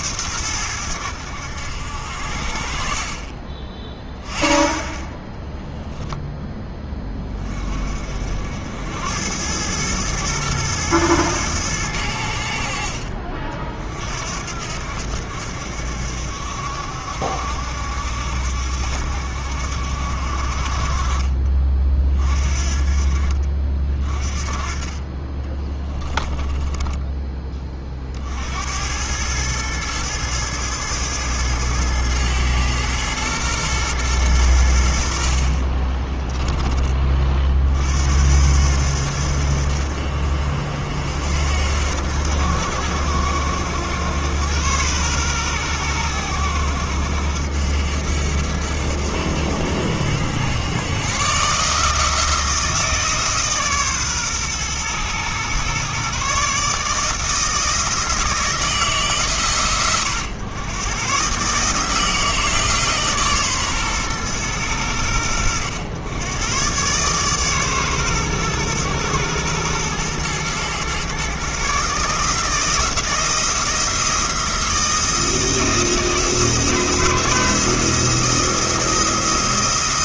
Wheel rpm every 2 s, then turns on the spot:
100, 40, 20, 10, 80, 110, 60, 70, 70, 70, 50, 40, 30, 10, 90, 110, 110, 80, 20, 80, 70, 90, 110, 90, 80, 120, 160, 120, 150, 160, 120, 150, 100, 130, 120, 120, 160, 160, 170, 170.
26-28